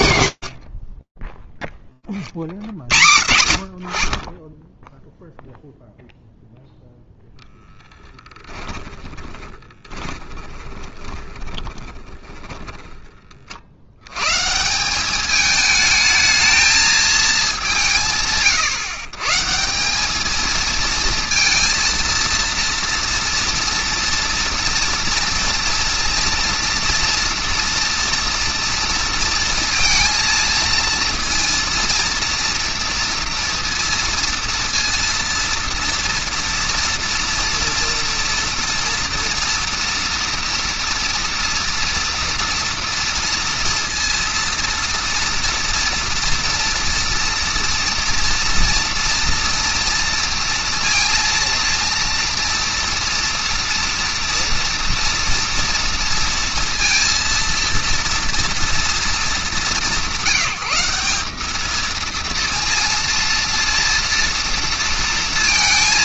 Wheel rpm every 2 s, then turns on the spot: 20, 40, 0, 0, 20, 20, 60, 210, 200, 150, 230, 230, 230, 230, 230, 230, 230, 230, 230, 230, 230, 230, 230, 230, 230, 230, 230, 230, 230, 180, 210, 230, 230.
8-12